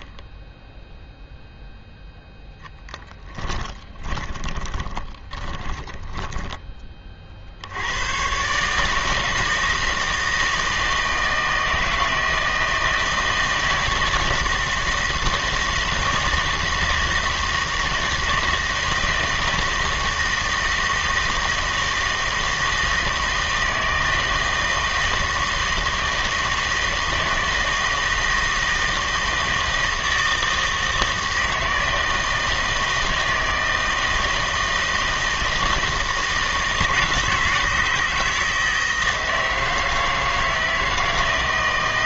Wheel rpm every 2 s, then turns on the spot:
0, 10, 20, 20, 140, 160, 160, 160, 160, 160, 160, 160, 160, 160, 160, 160, 160, 160, 160, 160, 160.
2-6